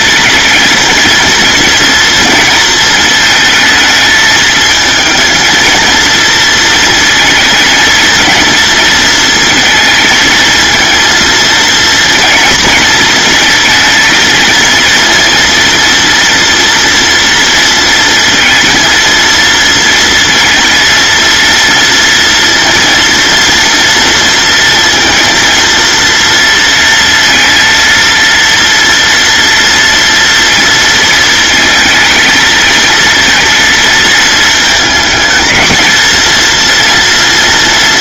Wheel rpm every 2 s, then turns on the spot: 230, 220, 220, 230, 230, 230, 230, 230, 230, 230, 230, 230, 230, 230, 230, 230, 230, 230, 230.
none